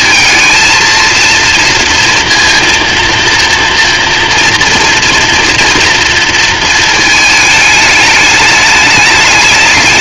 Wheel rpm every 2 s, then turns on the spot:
230, 230, 240, 220, 210.
none